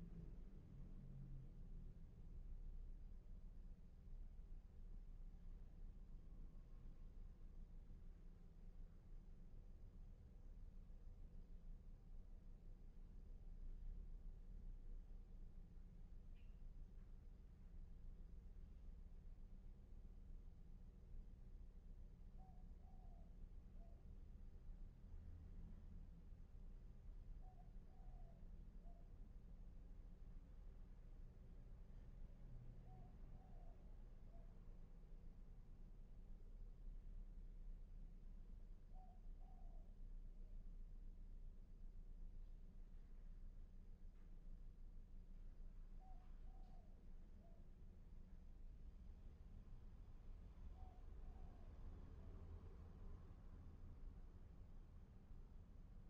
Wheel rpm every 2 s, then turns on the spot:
0, 0, 0, 0, 0, 0, 0, 0, 0, 0, 0, 0, 0, 0, 0, 0, 0, 0, 0, 0, 0, 0, 0, 0, 0, 0, 0, 0.
none